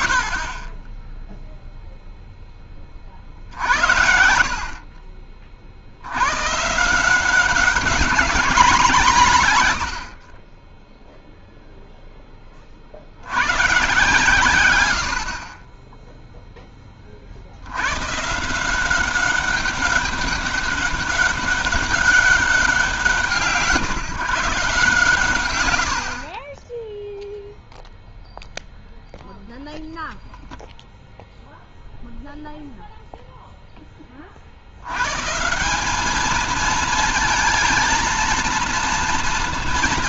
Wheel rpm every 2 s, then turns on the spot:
20, 40, 40, 160, 170, 10, 120, 60, 50, 190, 200, 170, 110, 0, 0, 0, 0, 150, 230, 220.
none